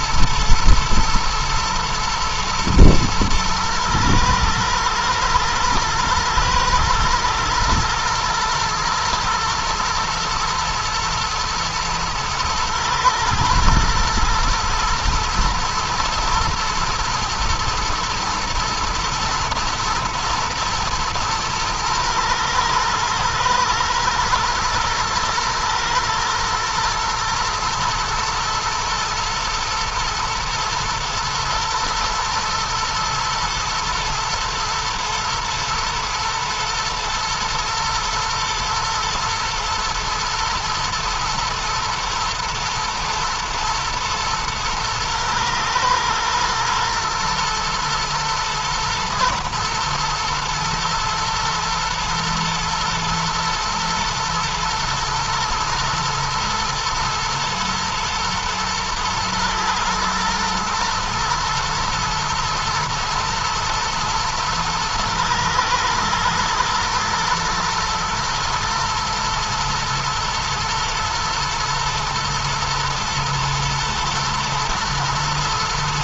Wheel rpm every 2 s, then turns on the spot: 110, 120, 110, 120, 110, 120, 110, 120, 110, 110, 120, 120, 110, 120, 110, 110, 110, 120, 120, 120, 110, 110, 110, 120, 120, 110, 110, 120, 120, 120, 120, 110, 110, 110, 110, 110, 110, 120.
none